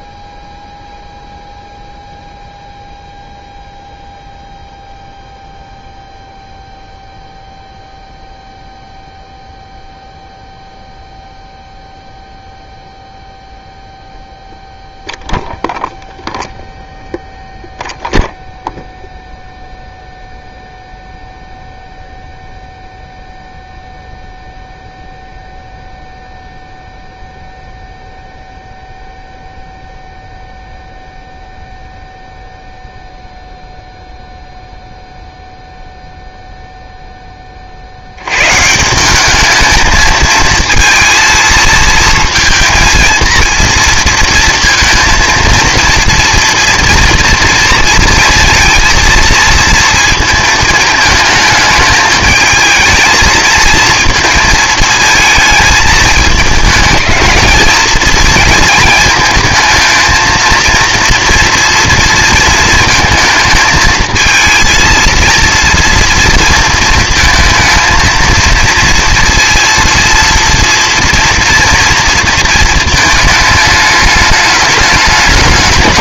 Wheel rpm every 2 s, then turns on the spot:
0, 0, 0, 0, 0, 0, 0, 0, 0, 0, 0, 0, 0, 0, 0, 0, 0, 0, 0, 150, 230, 230, 230, 230, 230, 220, 220, 220, 220, 230, 230, 230, 230, 220, 230, 230, 230, 210.
none